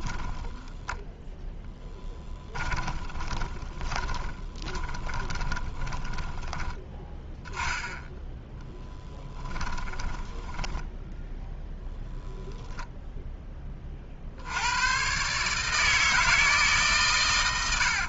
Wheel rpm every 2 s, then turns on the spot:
0, 20, 20, 10, 0, 10, 0, 110, 140.
2-6 10-12